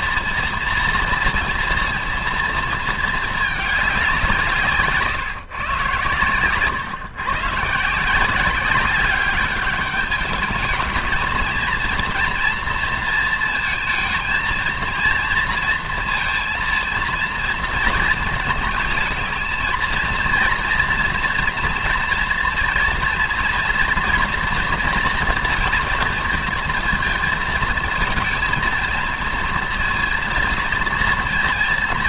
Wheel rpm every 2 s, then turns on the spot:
230, 230, 140, 140, 200, 220, 230, 230, 230, 220, 230, 230, 230, 230, 230, 230.
none